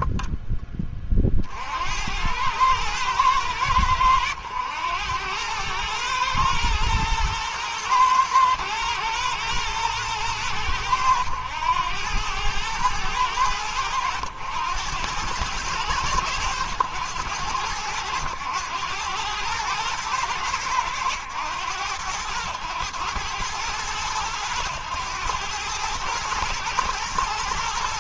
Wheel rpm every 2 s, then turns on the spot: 40, 110, 100, 110, 110, 100, 110, 100, 100, 110, 100, 110, 100, 110.
none